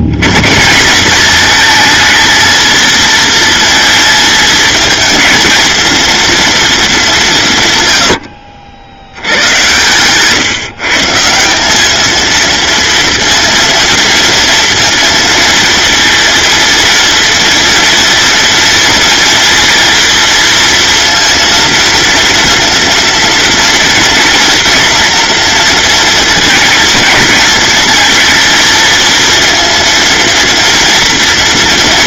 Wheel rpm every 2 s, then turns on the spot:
180, 230, 230, 220, 80, 150, 230, 230, 230, 230, 230, 230, 230, 230, 230, 230.
none